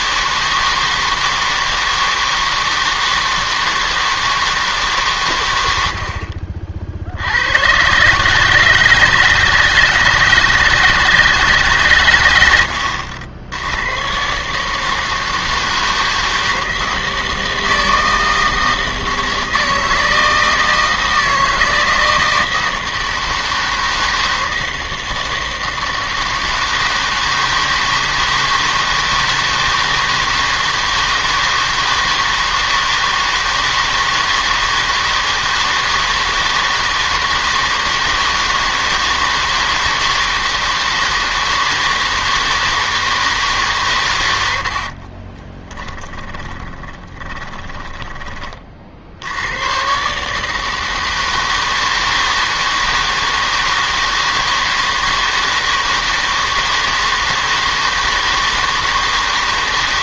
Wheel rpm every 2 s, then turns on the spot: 160, 160, 150, 40, 150, 160, 80, 150, 160, 160, 160, 170, 160, 160, 160, 160, 160, 160, 160, 160, 160, 160, 80, 10, 30, 160, 160, 160, 160, 160.
44-46